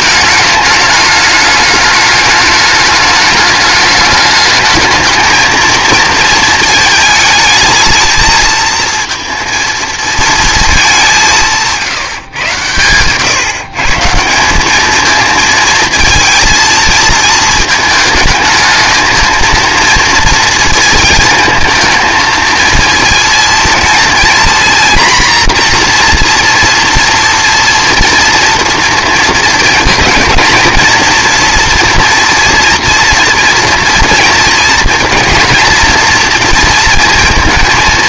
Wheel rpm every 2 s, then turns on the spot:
210, 210, 220, 220, 220, 210, 120, 200, 230, 220, 230, 230, 240, 240, 240, 230, 230, 230, 230.
none